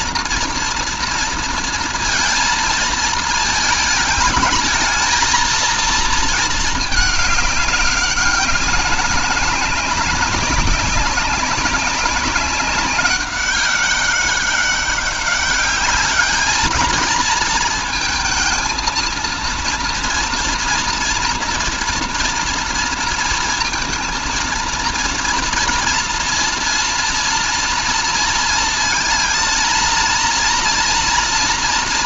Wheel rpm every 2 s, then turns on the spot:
230, 220, 210, 220, 200, 200, 190, 200, 220, 230, 240, 230, 230, 230, 230, 230.
none